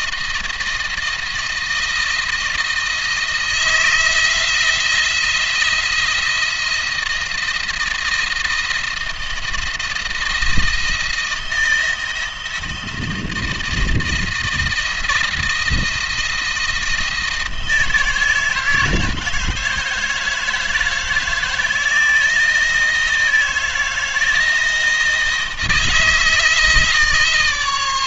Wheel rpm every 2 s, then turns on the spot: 170, 160, 170, 170, 170, 170, 160, 170, 170, 160, 160, 160, 160, 160.
none